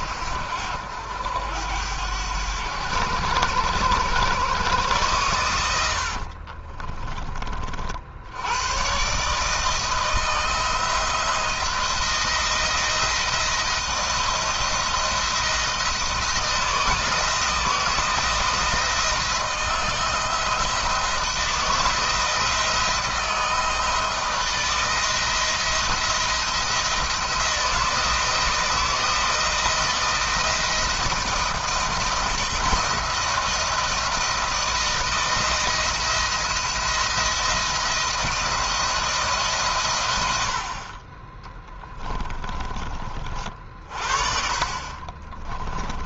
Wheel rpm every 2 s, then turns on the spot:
80, 90, 110, 40, 130, 170, 170, 170, 170, 170, 160, 160, 170, 160, 160, 170, 170, 170, 170, 160, 50, 30, 40.
6-8 44-46